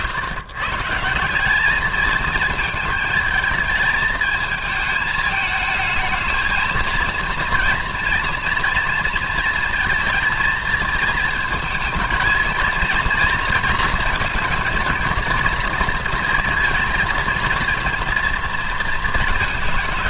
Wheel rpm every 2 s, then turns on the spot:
160, 220, 220, 230, 230, 230, 230, 220, 230, 230.
none